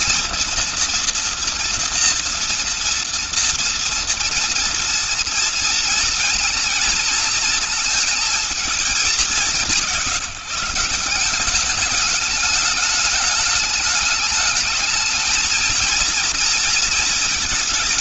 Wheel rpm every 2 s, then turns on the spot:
230, 230, 230, 230, 220, 170, 210, 210, 230.
none